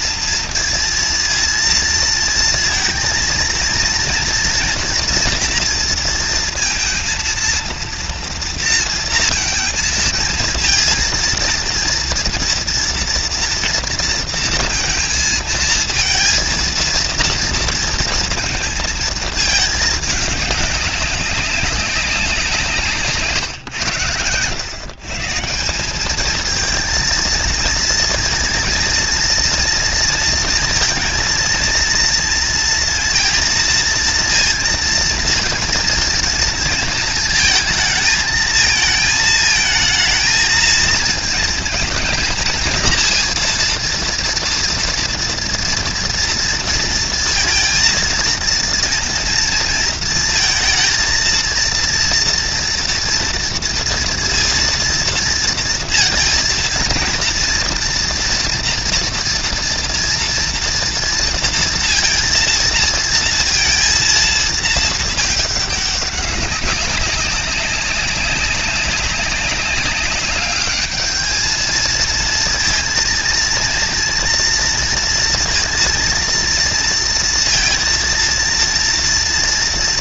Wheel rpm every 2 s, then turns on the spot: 230, 230, 230, 230, 230, 230, 230, 230, 230, 220, 200, 150, 130, 230, 230, 230, 230, 230, 230, 220, 230, 230, 230, 230, 230, 220, 240, 230, 230, 230, 230, 230, 220, 190, 200, 210, 230, 230, 230, 230.
none